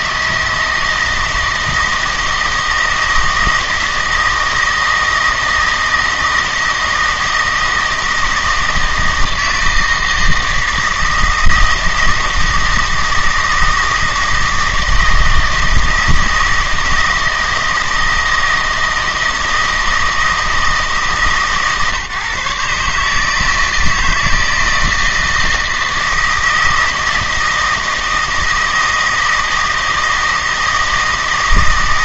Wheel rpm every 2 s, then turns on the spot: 160, 160, 160, 160, 160, 160, 160, 160, 160, 160, 160, 140, 160, 160, 160, 160.
none